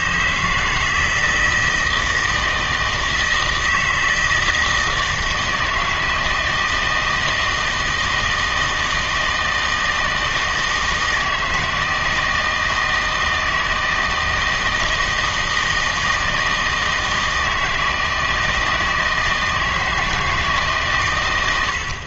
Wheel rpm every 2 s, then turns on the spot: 160, 160, 160, 160, 160, 160, 160, 160, 160, 160, 140.
none